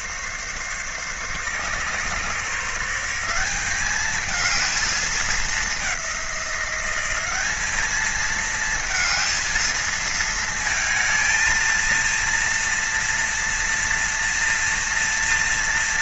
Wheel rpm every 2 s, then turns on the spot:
140, 160, 210, 180, 220, 220, 230, 230.
none